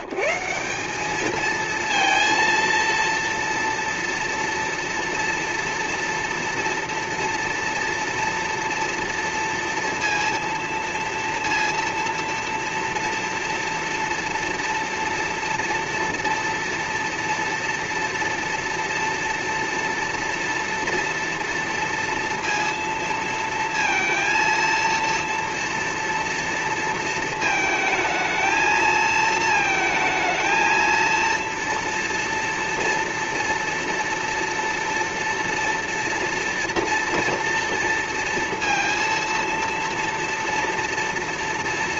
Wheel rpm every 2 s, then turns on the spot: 140, 230, 230, 230, 230, 230, 230, 240, 230, 230, 230, 230, 230, 230, 220, 220, 230, 230, 230, 230, 230.
none